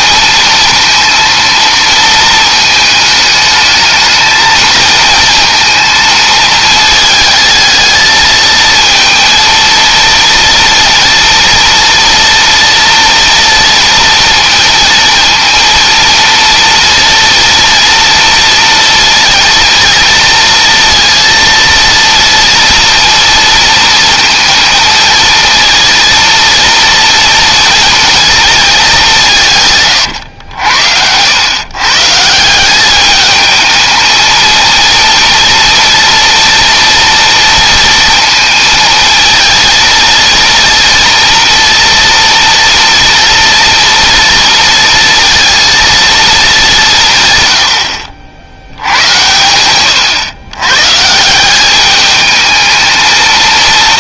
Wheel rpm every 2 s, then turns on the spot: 230, 220, 220, 220, 220, 230, 230, 230, 230, 230, 230, 230, 230, 230, 190, 80, 200, 230, 230, 220, 230, 230, 230, 170, 90, 140, 220.
none